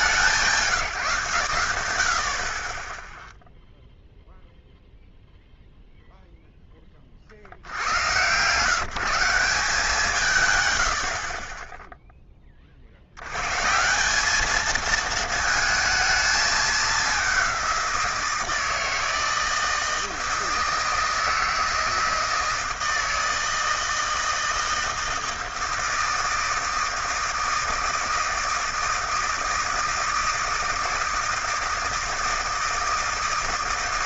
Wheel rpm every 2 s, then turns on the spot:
120, 0, 0, 40, 160, 40, 90, 220, 190, 160, 160, 160, 160, 160, 160, 160, 160.
10-12